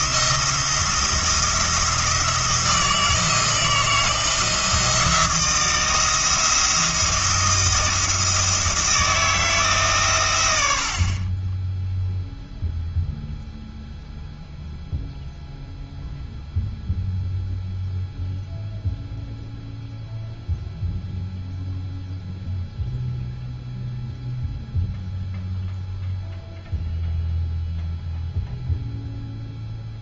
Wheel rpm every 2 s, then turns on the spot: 170, 160, 170, 170, 170, 70, 0, 0, 0, 0, 0, 0, 0, 0, 0.
none